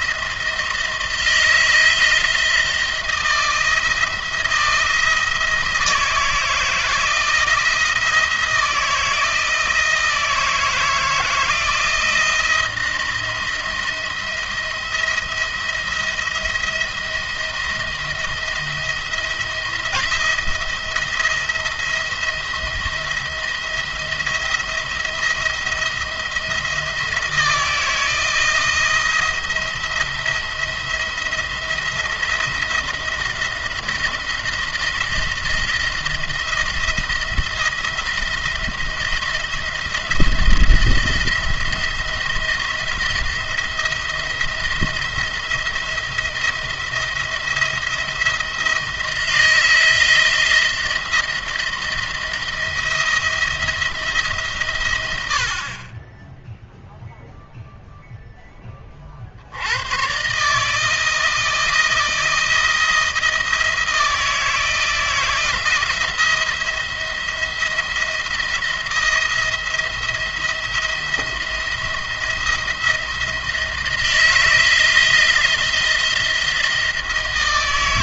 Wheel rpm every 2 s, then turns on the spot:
160, 160, 170, 160, 170, 160, 170, 170, 170, 170, 170, 170, 170, 170, 170, 170, 170, 170, 160, 170, 160, 170, 170, 170, 170, 170, 170, 130, 0, 20, 150, 170, 160, 170, 170, 170, 170, 160, 170.
none